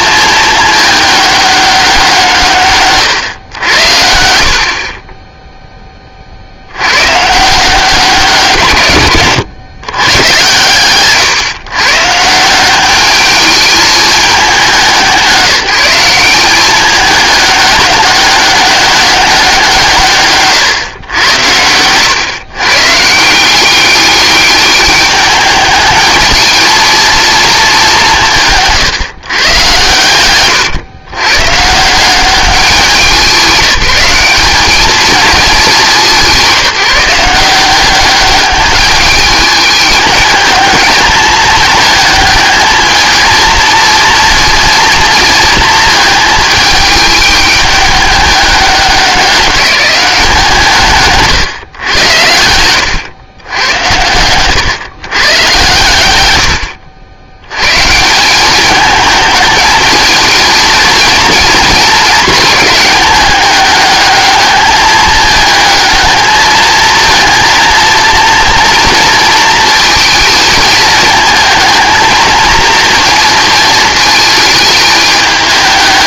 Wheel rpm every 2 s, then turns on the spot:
210, 140, 60, 90, 140, 110, 180, 190, 200, 200, 120, 120, 210, 220, 160, 120, 200, 210, 180, 200, 220, 220, 230, 220, 200, 160, 100, 120, 90, 210, 220, 220, 210, 220, 230, 220, 230, 210.
28-30 52-54